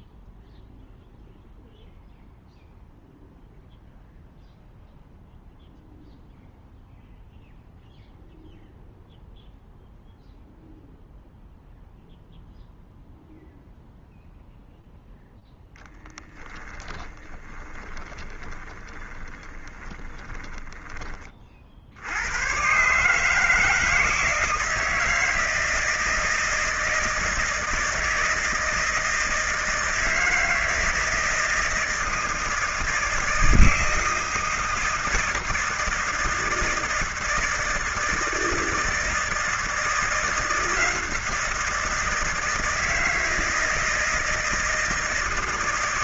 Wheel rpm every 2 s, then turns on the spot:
0, 0, 0, 0, 0, 0, 0, 0, 10, 20, 20, 120, 160, 160, 160, 160, 160, 160, 160, 160, 170, 160, 160.
16-22